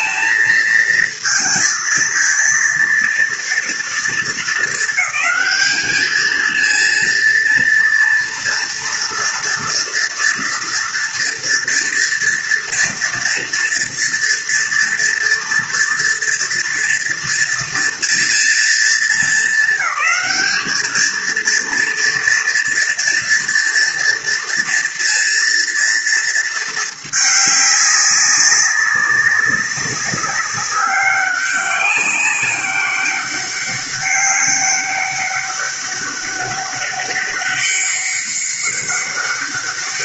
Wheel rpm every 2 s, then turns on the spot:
230, 230, 200, 230, 230, 240, 230, 230, 240, 210, 210, 230, 230, 210, 200, 200, 200, 200, 200, 200.
none